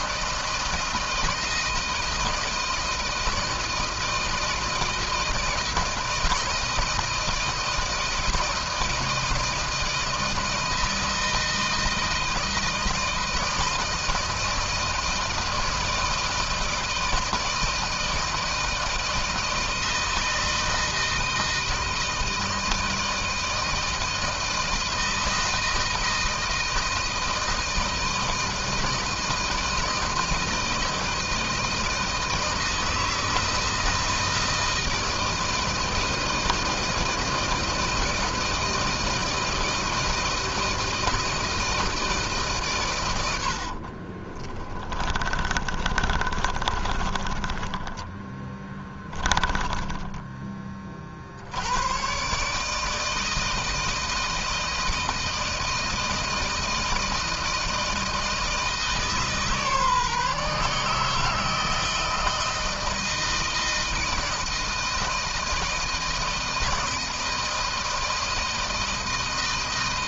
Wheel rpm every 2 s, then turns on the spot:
160, 160, 160, 160, 160, 160, 160, 160, 160, 160, 160, 160, 160, 160, 160, 160, 160, 160, 160, 160, 160, 130, 20, 20, 10, 30, 150, 160, 160, 160, 150, 160, 160, 160, 160.
44-50